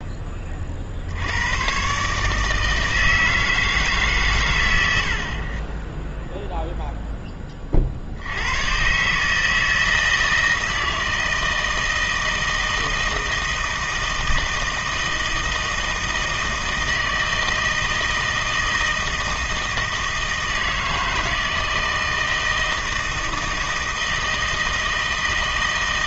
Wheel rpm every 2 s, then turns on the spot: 50, 160, 100, 0, 110, 160, 160, 160, 160, 160, 160, 160, 160.
none